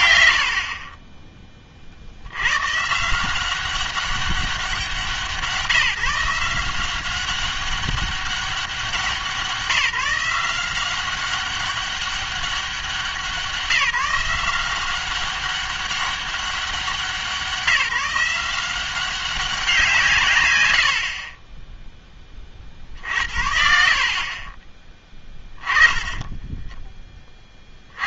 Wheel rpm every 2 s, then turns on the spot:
100, 110, 190, 180, 190, 180, 190, 180, 190, 180, 100, 20, 50, 10.
24-28